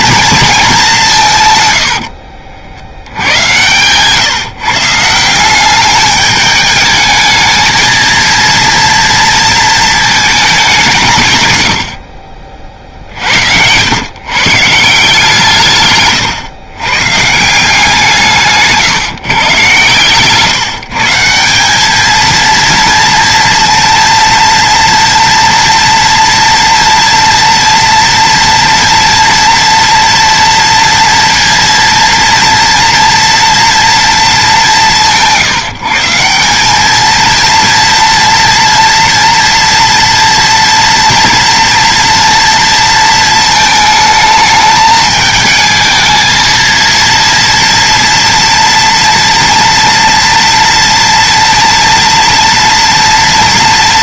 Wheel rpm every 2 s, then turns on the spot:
210, 80, 150, 210, 230, 200, 50, 160, 130, 140, 150, 230, 230, 230, 240, 230, 230, 190, 200, 240, 240, 230, 220, 230, 230, 230, 230.
none